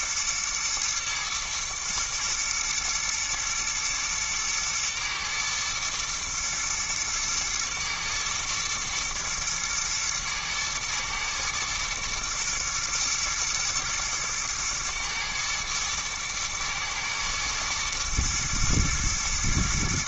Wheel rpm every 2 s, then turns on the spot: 120, 120, 110, 110, 110, 110, 120, 110, 110, 110.
none